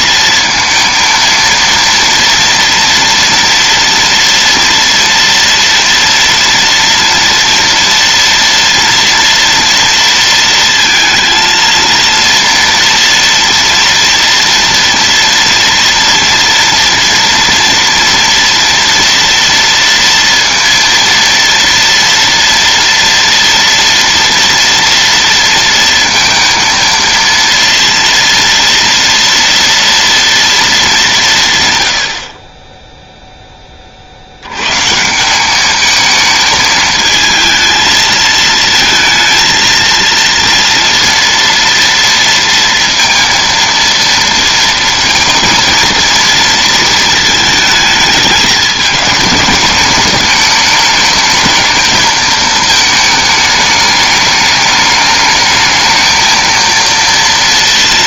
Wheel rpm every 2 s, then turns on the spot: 230, 230, 230, 230, 230, 230, 230, 230, 230, 230, 230, 230, 230, 230, 230, 210, 10, 120, 220, 220, 230, 230, 230, 220, 220, 220, 220, 210, 230.
none